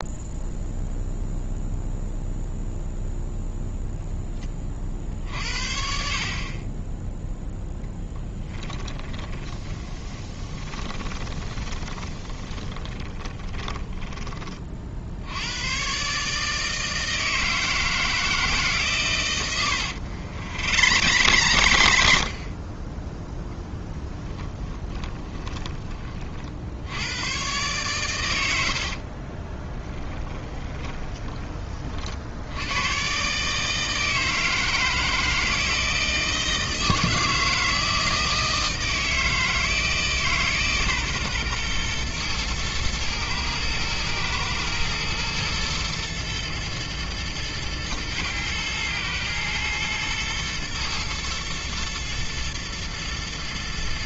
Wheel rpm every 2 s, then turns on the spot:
0, 0, 40, 10, 10, 30, 20, 50, 160, 140, 100, 10, 20, 80, 60, 20, 110, 160, 160, 160, 130, 110, 120, 110, 110, 110, 110.
8-14 20-22 24-26 28-32